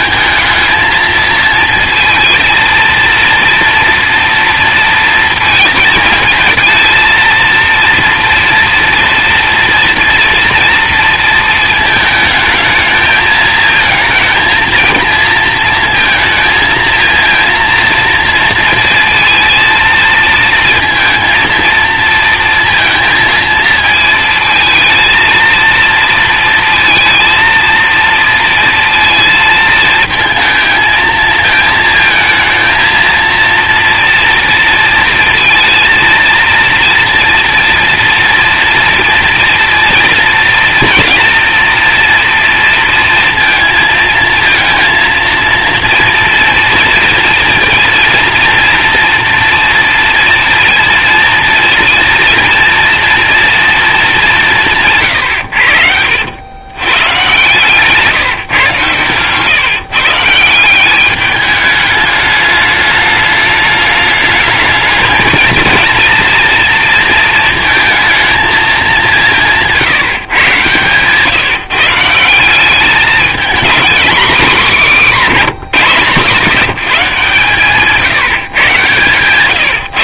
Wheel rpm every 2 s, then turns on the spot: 220, 230, 230, 230, 230, 230, 220, 220, 230, 230, 230, 230, 230, 230, 230, 220, 220, 230, 230, 230, 240, 230, 230, 230, 230, 230, 230, 170, 110, 130, 170, 210, 220, 230, 220, 130, 190, 210, 160, 150.
70-72